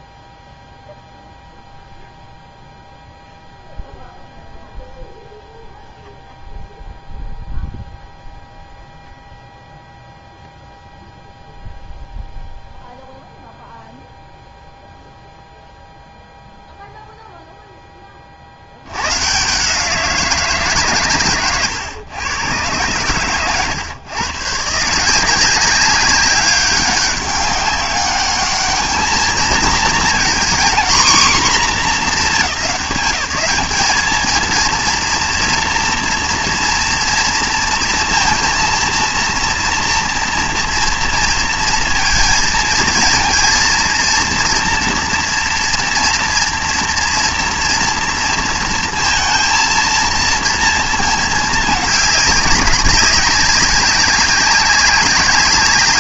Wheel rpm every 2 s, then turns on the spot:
0, 0, 0, 0, 0, 0, 0, 0, 0, 90, 160, 120, 140, 200, 220, 230, 180, 230, 230, 230, 230, 230, 230, 230, 230, 230, 190, 200.
none